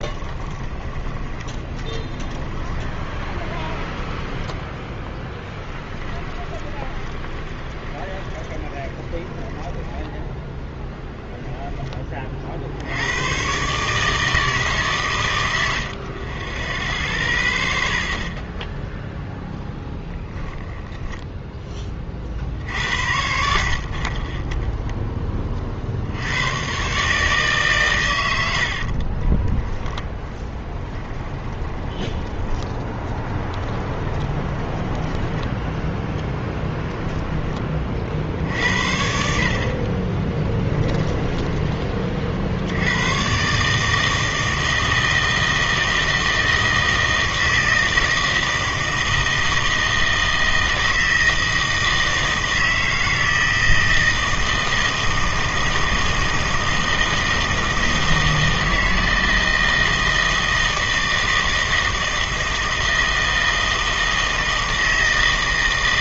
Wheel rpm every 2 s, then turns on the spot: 20, 20, 10, 20, 10, 10, 70, 140, 10, 0, 0, 70, 10, 120, 70, 10, 20, 20, 10, 60, 10, 70, 160, 160, 160, 160, 160, 160, 160, 160, 160, 160, 160.
0-4 6-10 28-38 40-42